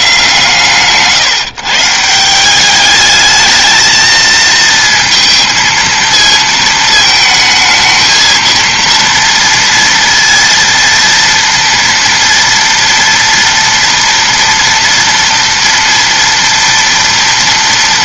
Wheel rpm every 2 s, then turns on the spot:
150, 200, 230, 220, 230, 230, 230, 230, 230.
none